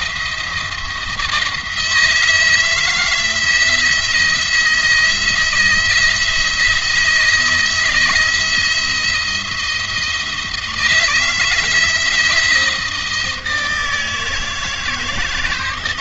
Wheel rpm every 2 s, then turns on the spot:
170, 160, 170, 170, 170, 160, 160, 150.
none